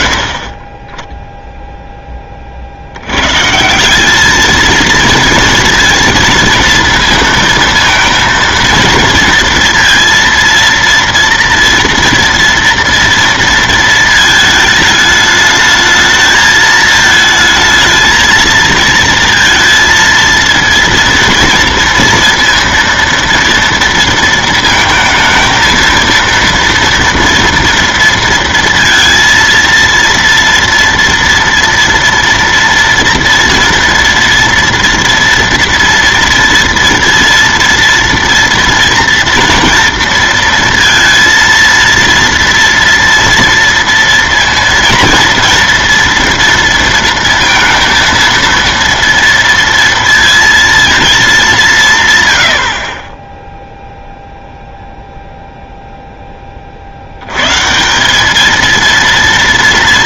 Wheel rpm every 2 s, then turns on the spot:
20, 50, 220, 230, 230, 230, 230, 220, 220, 220, 230, 230, 220, 230, 230, 230, 230, 230, 230, 230, 230, 230, 230, 230, 230, 230, 60, 0, 30, 220.
none